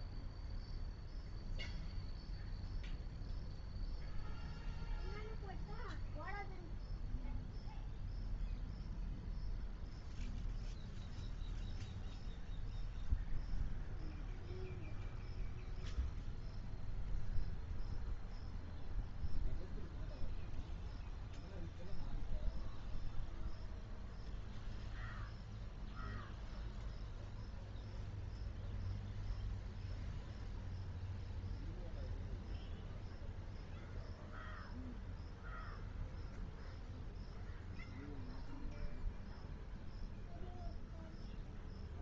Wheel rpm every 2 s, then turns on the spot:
0, 0, 0, 0, 0, 0, 0, 0, 0, 0, 0, 0, 0, 0, 0, 0, 0, 0, 0, 0, 0.
none